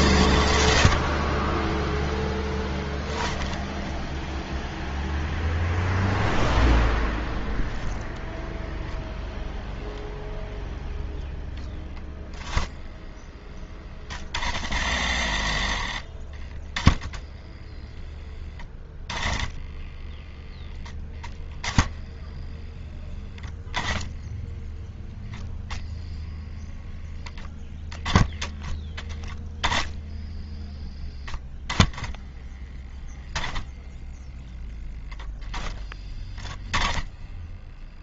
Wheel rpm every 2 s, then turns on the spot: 60, 10, 0, 0, 0, 0, 0, 60, 10, 10, 0, 10, 10, 10, 10, 0, 10, 0, 0.
none